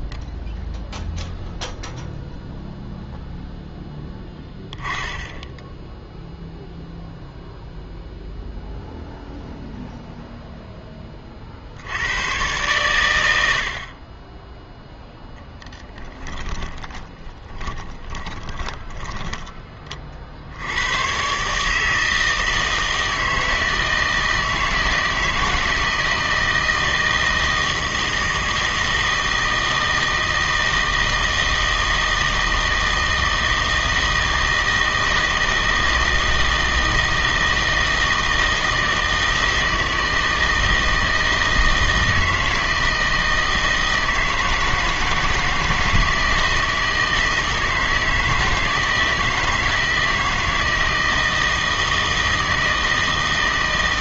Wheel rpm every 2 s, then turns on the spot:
0, 0, 10, 0, 0, 10, 120, 0, 20, 20, 80, 160, 160, 160, 160, 160, 160, 160, 160, 160, 160, 160, 160, 160, 160, 160, 160.
16-20